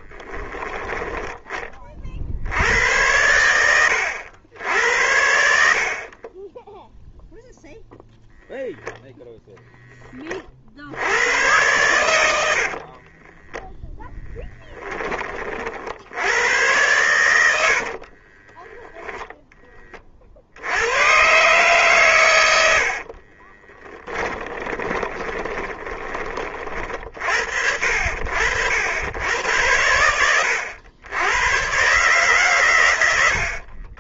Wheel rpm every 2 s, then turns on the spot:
10, 80, 80, 10, 10, 70, 60, 10, 100, 10, 90, 70, 20, 40, 80, 100, 120.
6-8 12-14 18-20 24-26